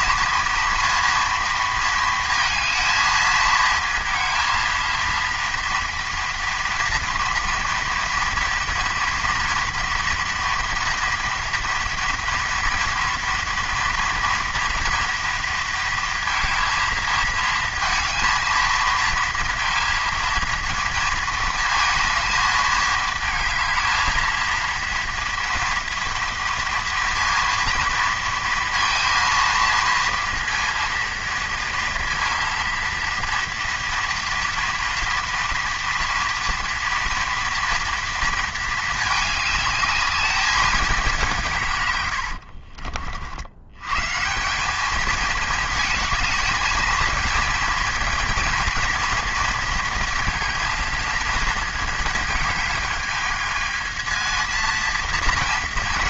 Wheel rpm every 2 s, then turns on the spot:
230, 230, 230, 230, 230, 230, 230, 230, 220, 230, 230, 220, 230, 230, 230, 230, 230, 230, 230, 220, 200, 60, 200, 220, 230, 230, 220, 230.
none